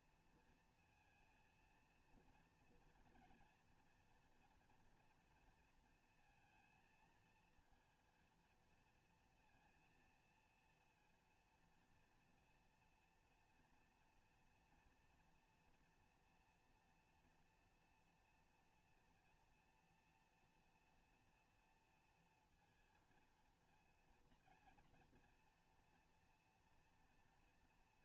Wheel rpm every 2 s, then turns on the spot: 230, 230, 230, 230, 230, 230, 230, 230, 230, 240, 230, 230, 230, 230.
none